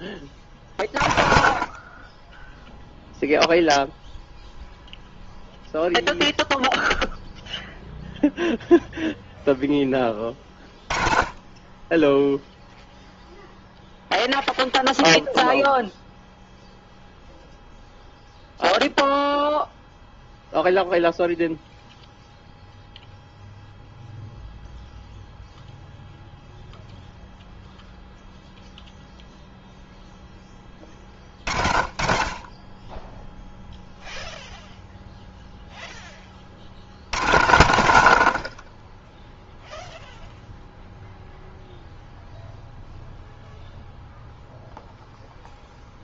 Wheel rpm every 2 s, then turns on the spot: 40, 10, 0, 0, 0, 10, 0, 0, 0, 0, 0, 0, 0, 0, 0, 10, 10, 0, 70, 50, 0, 0, 0.
none